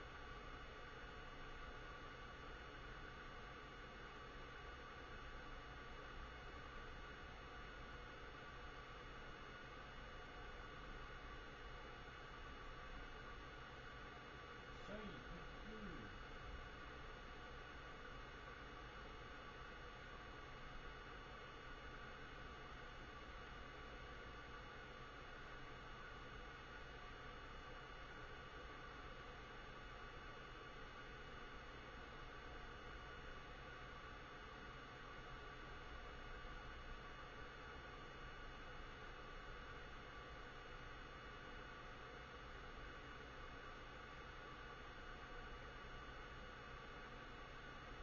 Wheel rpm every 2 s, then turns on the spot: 0, 0, 0, 0, 0, 0, 0, 0, 0, 0, 0, 0, 0, 0, 0, 0, 0, 0, 0, 0, 0, 0, 0, 0.
none